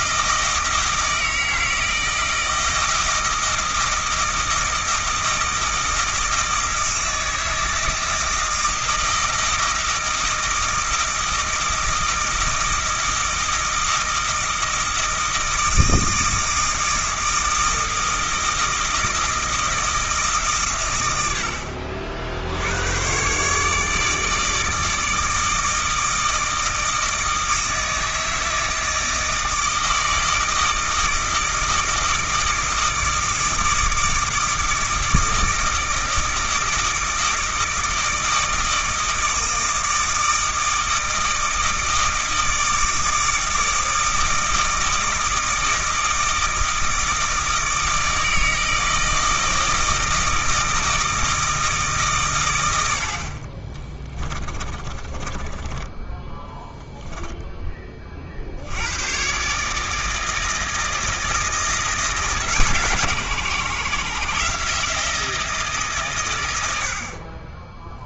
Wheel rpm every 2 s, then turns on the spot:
160, 160, 160, 160, 160, 160, 160, 160, 160, 160, 140, 80, 160, 160, 160, 160, 160, 160, 160, 160, 160, 160, 160, 160, 160, 160, 100, 20, 10, 70, 160, 150, 160, 90.
54-58